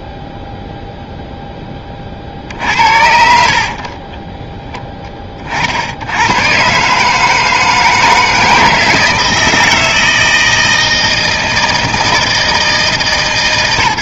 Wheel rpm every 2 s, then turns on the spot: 0, 60, 10, 130, 160, 160, 160.
none